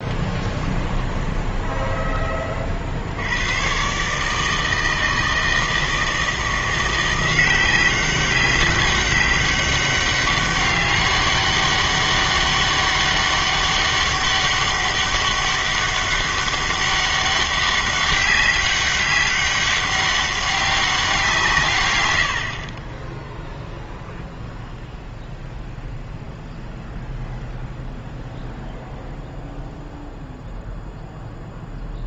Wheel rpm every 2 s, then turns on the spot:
10, 40, 160, 170, 190, 200, 200, 200, 200, 200, 200, 40, 0, 0, 0, 0.
0-2